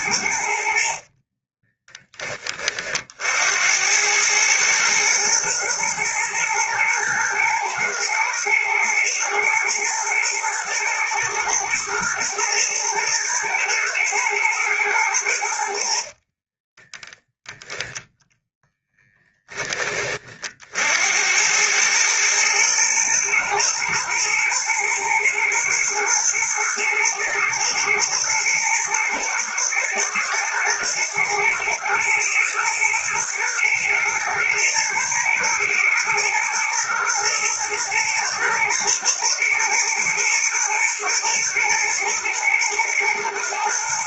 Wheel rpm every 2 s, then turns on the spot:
60, 40, 110, 110, 120, 110, 120, 110, 20, 10, 70, 110, 110, 120, 110, 120, 120, 110, 110, 110, 120, 110.
0-2 16-18